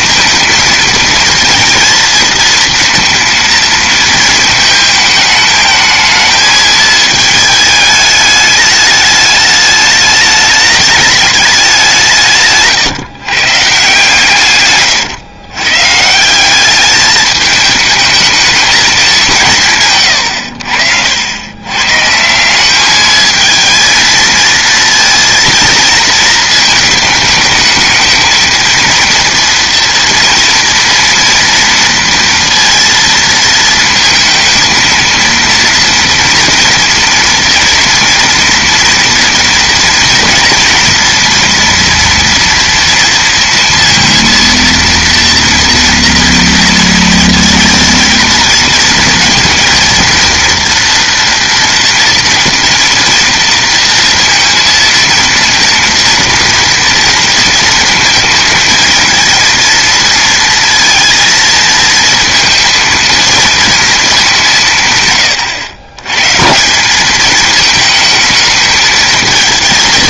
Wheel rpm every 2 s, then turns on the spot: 230, 230, 220, 220, 210, 210, 150, 130, 180, 220, 80, 180, 230, 220, 220, 230, 230, 230, 230, 230, 230, 230, 230, 230, 230, 230, 240, 230, 230, 230, 230, 230, 170, 150, 220.
12-14